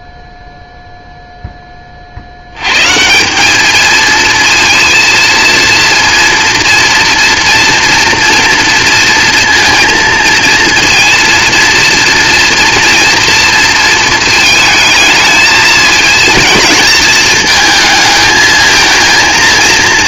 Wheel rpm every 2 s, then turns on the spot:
0, 100, 230, 230, 230, 230, 230, 220, 230, 220.
none